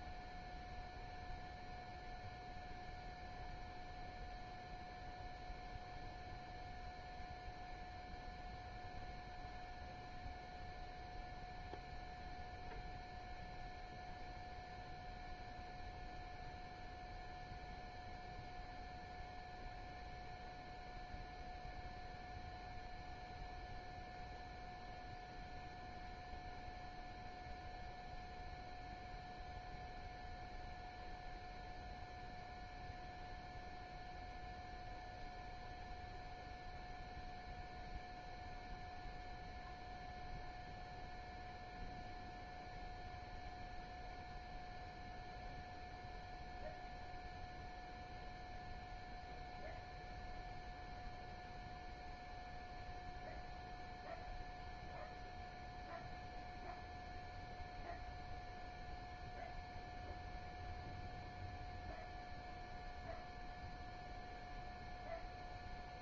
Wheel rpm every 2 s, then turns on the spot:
0, 0, 0, 0, 0, 0, 0, 0, 0, 0, 0, 0, 0, 0, 0, 0, 0, 0, 0, 0, 0, 0, 0, 0, 0, 0, 0, 0, 0, 0, 0, 0, 0.
none